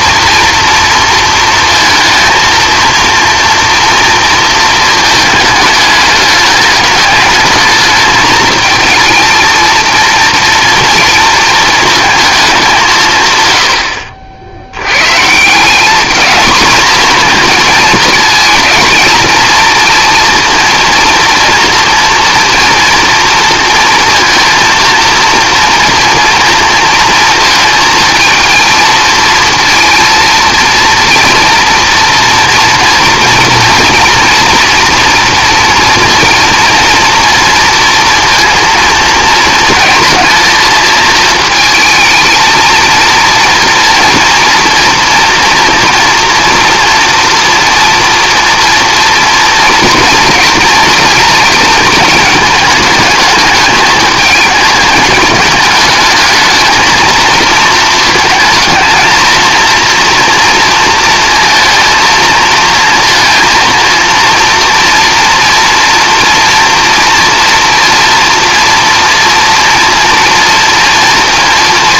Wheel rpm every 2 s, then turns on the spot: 230, 230, 230, 210, 220, 230, 190, 90, 230, 220, 230, 230, 230, 230, 230, 230, 230, 230, 230, 230, 230, 230, 230, 240, 230, 230, 220, 220, 220, 220, 230, 230, 230, 230, 230, 230.
none